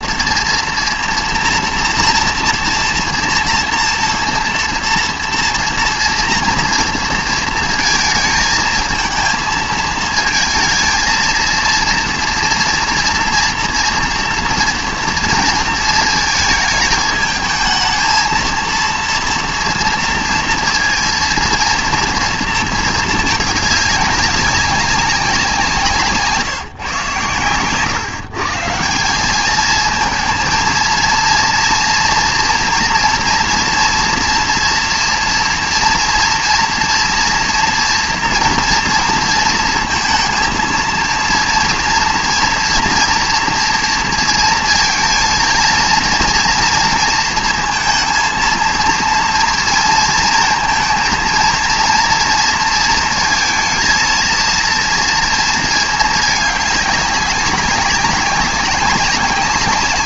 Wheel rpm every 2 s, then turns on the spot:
230, 230, 230, 230, 220, 230, 230, 230, 220, 230, 230, 230, 190, 140, 150, 220, 240, 240, 240, 230, 230, 240, 230, 230, 230, 220, 230, 230, 210, 190.
none